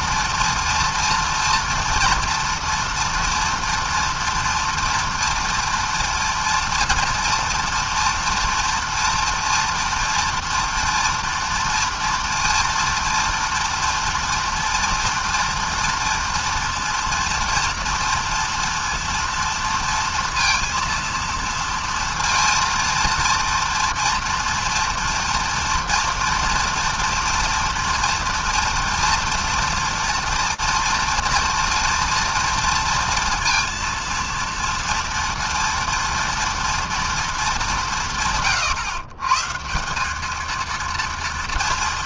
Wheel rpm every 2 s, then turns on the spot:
230, 230, 230, 230, 230, 230, 230, 230, 240, 230, 230, 230, 230, 230, 230, 230, 230, 230, 230, 140, 230.
none